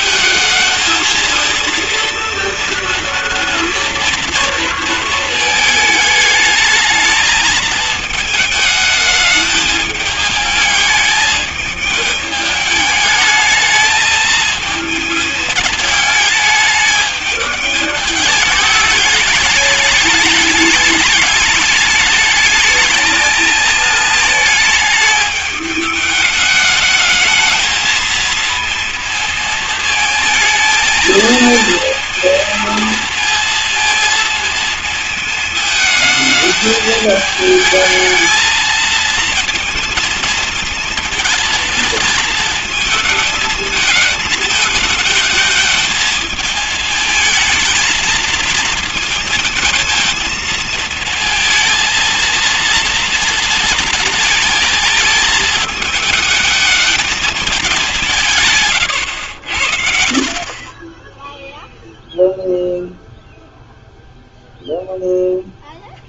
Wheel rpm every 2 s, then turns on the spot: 220, 230, 220, 220, 220, 210, 210, 220, 220, 210, 210, 220, 220, 210, 220, 220, 230, 220, 210, 220, 220, 220, 220, 220, 230, 220, 230, 220, 210, 130, 30, 0, 0.
60-62